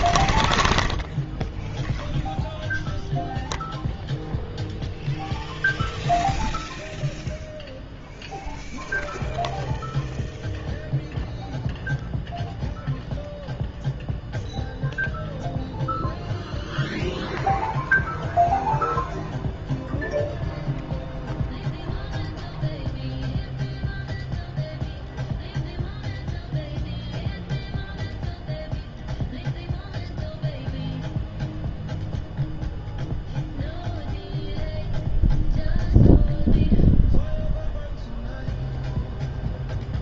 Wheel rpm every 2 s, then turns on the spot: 0, 0, 0, 0, 0, 0, 0, 0, 0, 0, 0, 0, 0, 0, 0, 0, 0, 0, 0, 0.
none